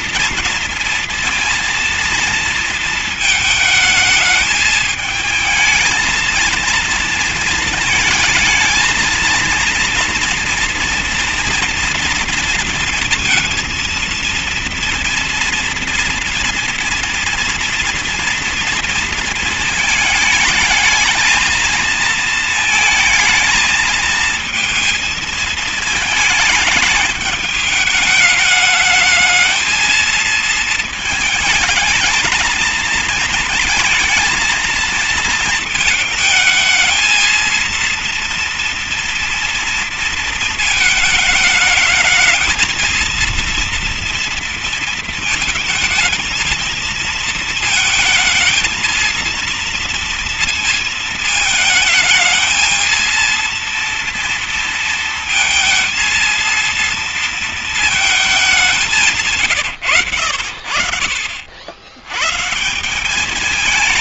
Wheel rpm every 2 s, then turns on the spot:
230, 230, 220, 230, 230, 230, 230, 230, 240, 230, 220, 230, 230, 210, 210, 220, 220, 230, 220, 230, 220, 220, 230, 220, 220, 230, 220, 230, 230, 200, 60, 140.
none